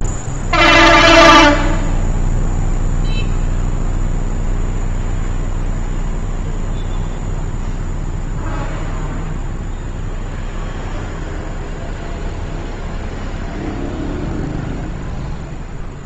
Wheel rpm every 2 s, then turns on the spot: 0, 0, 0, 0, 0, 0, 0, 0.
none